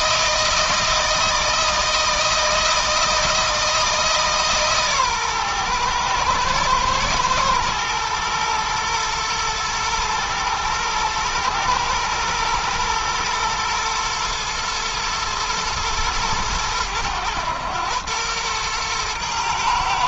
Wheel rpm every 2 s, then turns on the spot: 160, 160, 140, 110, 110, 110, 120, 120, 100, 110.
none